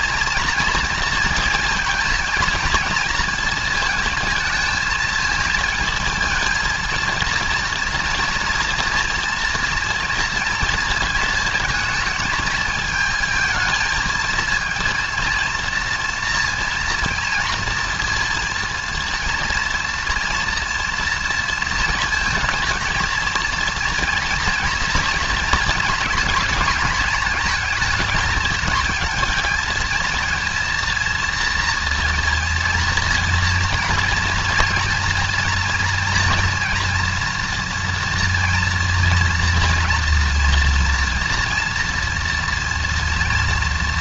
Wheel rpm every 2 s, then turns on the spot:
230, 220, 220, 230, 230, 230, 220, 220, 230, 230, 230, 230, 230, 220, 220, 230, 230, 230, 230, 230, 230, 230.
none